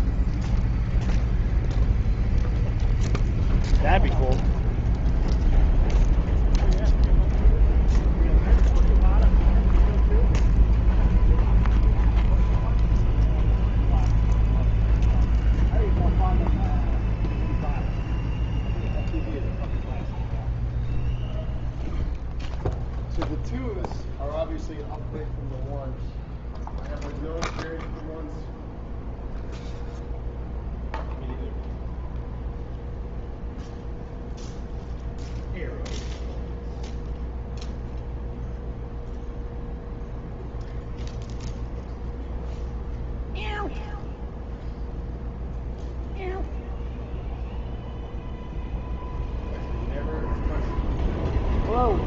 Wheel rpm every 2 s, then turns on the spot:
0, 0, 0, 0, 0, 0, 0, 0, 0, 0, 0, 0, 0, 0, 0, 0, 0, 0, 0, 0, 0, 0, 0, 0, 0, 0.
none